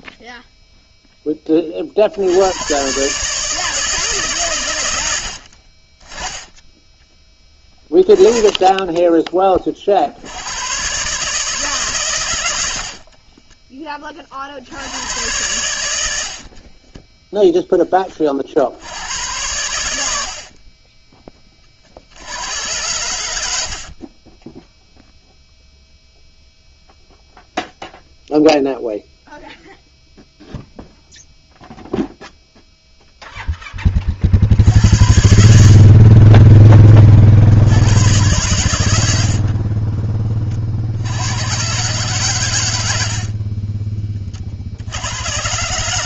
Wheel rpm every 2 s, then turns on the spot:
0, 130, 90, 10, 10, 130, 60, 90, 20, 80, 20, 100, 0, 0, 0, 0, 0, 70, 30, 80, 60, 80, 80.
12-14 16-18